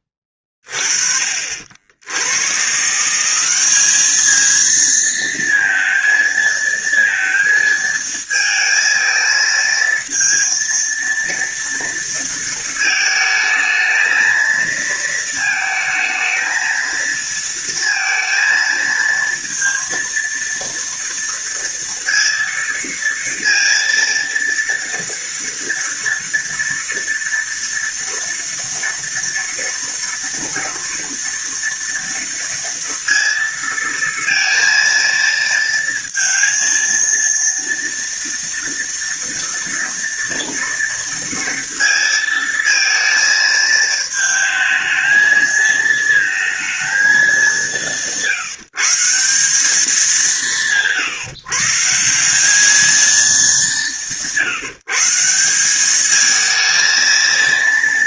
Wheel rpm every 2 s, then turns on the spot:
20, 130, 220, 230, 220, 230, 220, 220, 220, 230, 230, 230, 230, 230, 230, 230, 230, 230, 230, 230, 230, 230, 220, 220, 160, 170, 210, 150, 220.
none